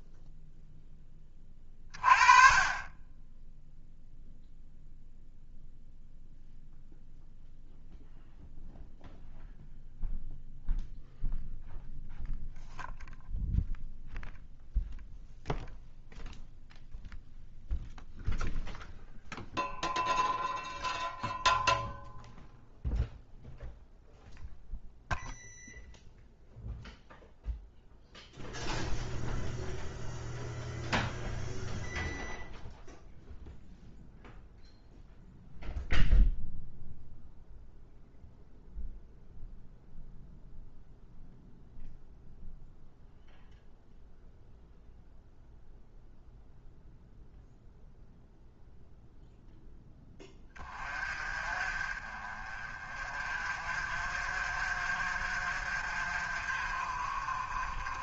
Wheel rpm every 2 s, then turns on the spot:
10, 20, 0, 0, 0, 0, 0, 0, 0, 0, 0, 0, 0, 0, 0, 0, 0, 0, 0, 0, 0, 0, 0, 0, 0, 30, 30, 50, 40.
none